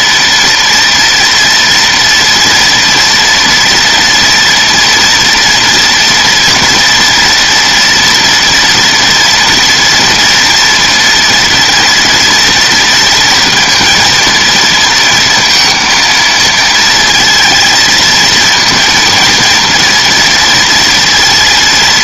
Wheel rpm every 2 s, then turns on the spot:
230, 230, 240, 230, 230, 230, 230, 230, 230, 230, 230.
none